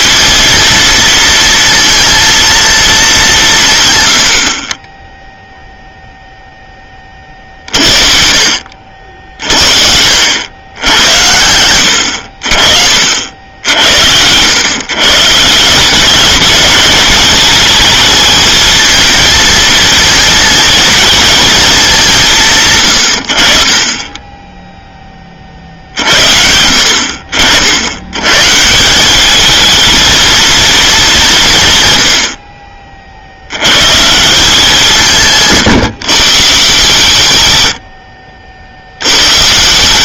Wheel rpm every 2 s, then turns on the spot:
230, 230, 30, 30, 50, 100, 50, 130, 200, 220, 220, 120, 0, 70, 180, 220, 40, 180, 140, 70.
none